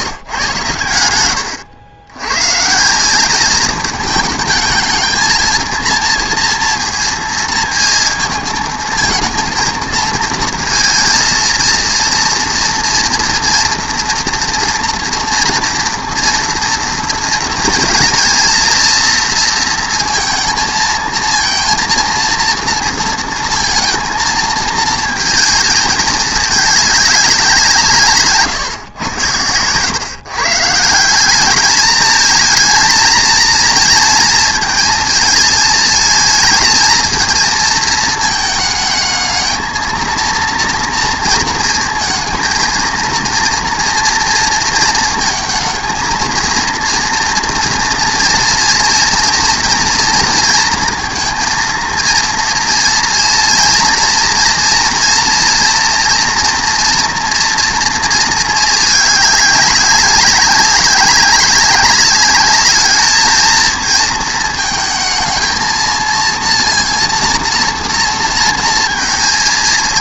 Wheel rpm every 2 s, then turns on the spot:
120, 130, 220, 230, 220, 220, 230, 240, 230, 230, 230, 230, 230, 210, 140, 140, 230, 230, 220, 220, 230, 230, 230, 230, 230, 230, 230, 240, 240, 220, 190, 200, 220, 230, 230.
none